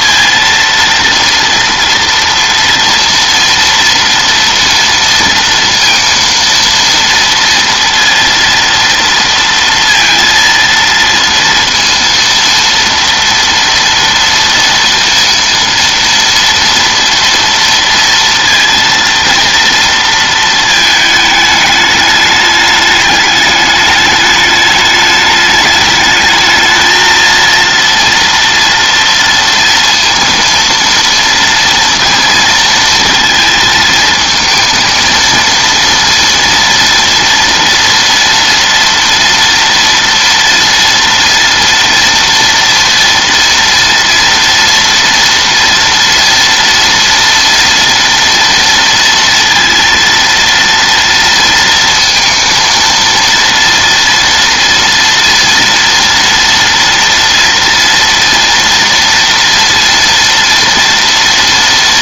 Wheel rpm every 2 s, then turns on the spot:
230, 230, 230, 230, 230, 230, 230, 230, 240, 230, 220, 210, 210, 220, 230, 230, 230, 230, 230, 230, 230, 230, 230, 230, 230, 230, 230, 230, 230, 230, 230.
none